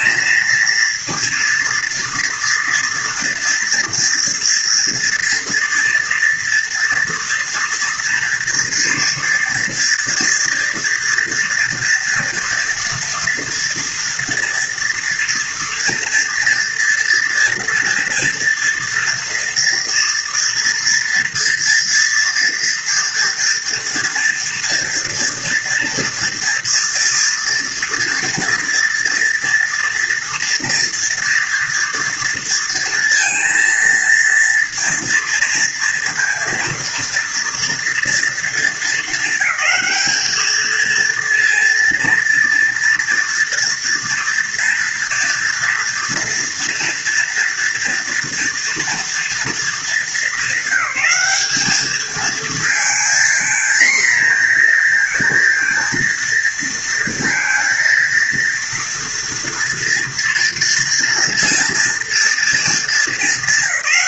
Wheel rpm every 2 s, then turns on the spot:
230, 230, 230, 240, 230, 230, 230, 230, 230, 230, 230, 230, 230, 230, 230, 230, 230, 230, 230, 220, 230, 230, 230, 230, 240, 210, 230, 230, 230, 230, 230, 210.
none